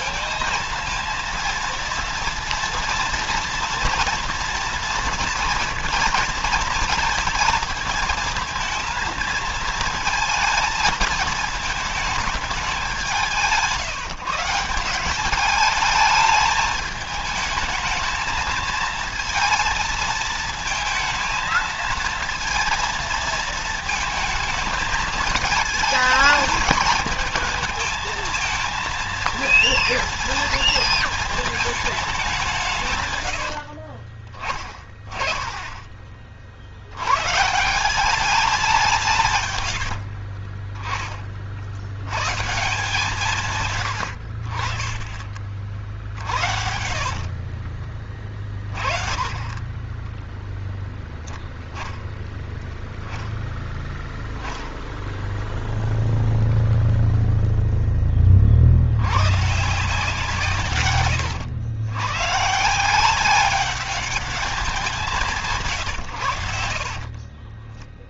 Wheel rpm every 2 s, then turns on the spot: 230, 230, 230, 230, 230, 220, 200, 180, 210, 220, 220, 230, 220, 220, 230, 230, 150, 20, 70, 180, 30, 150, 50, 30, 30, 0, 0, 10, 0, 60, 140, 170, 190, 60.
32-34 46-50 66-68